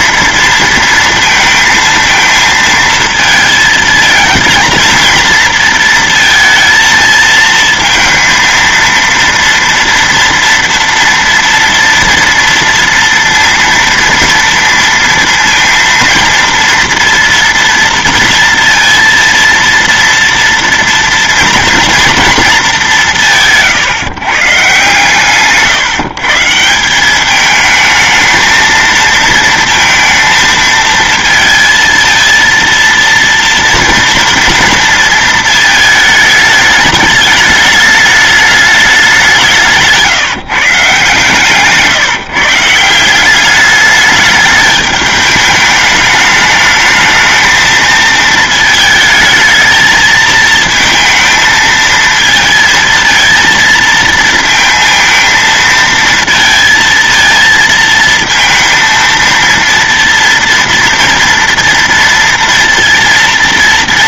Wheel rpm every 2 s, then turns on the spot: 230, 220, 230, 220, 230, 230, 230, 230, 230, 230, 230, 170, 140, 200, 230, 230, 230, 230, 210, 190, 160, 190, 210, 220, 220, 230, 230, 220, 230, 230, 230, 230.
none